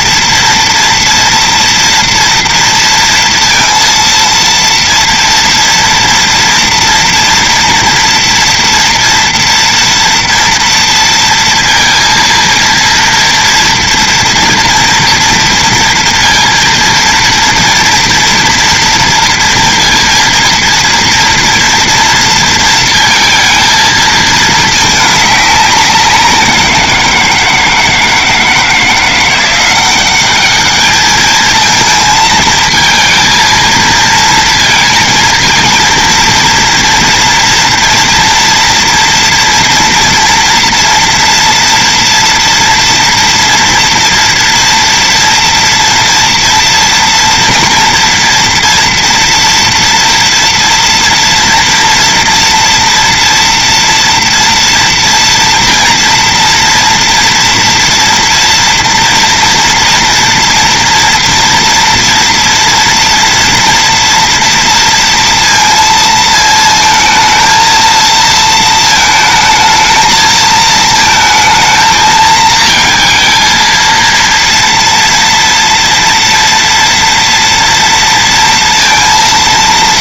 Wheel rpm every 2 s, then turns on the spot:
230, 230, 230, 230, 230, 230, 230, 240, 230, 230, 230, 230, 220, 180, 160, 190, 220, 230, 230, 230, 230, 230, 240, 230, 230, 230, 230, 230, 230, 230, 230, 230, 230, 220, 230, 220, 220, 230, 230, 230.
none